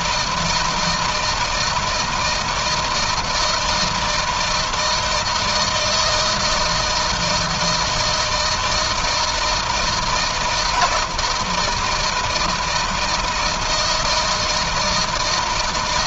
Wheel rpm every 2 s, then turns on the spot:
160, 160, 160, 160, 160, 170, 160, 160.
none